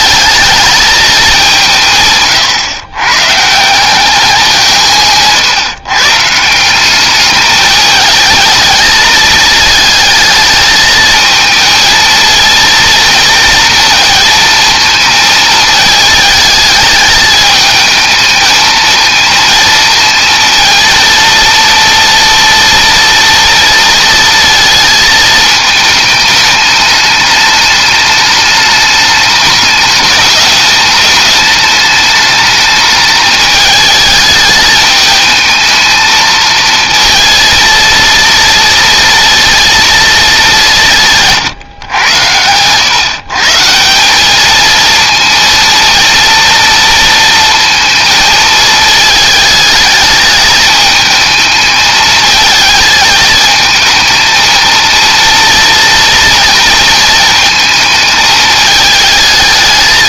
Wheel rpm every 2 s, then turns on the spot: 200, 130, 160, 200, 220, 220, 230, 220, 210, 220, 230, 230, 220, 210, 210, 210, 210, 220, 230, 230, 150, 140, 230, 230, 220, 220, 220, 230, 220, 220.
4-6